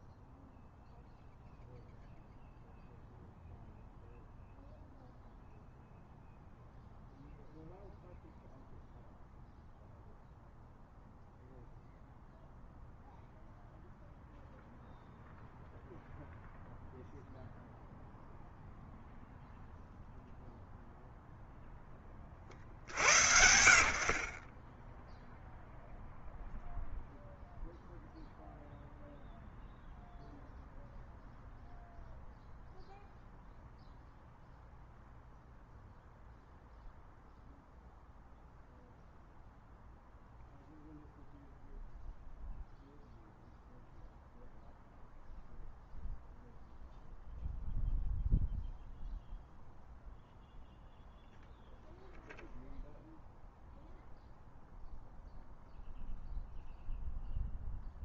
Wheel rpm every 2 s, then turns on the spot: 0, 0, 0, 0, 0, 0, 0, 0, 0, 0, 0, 60, 20, 0, 0, 0, 0, 0, 0, 0, 0, 0, 0, 0, 0, 0, 0, 0, 0.
none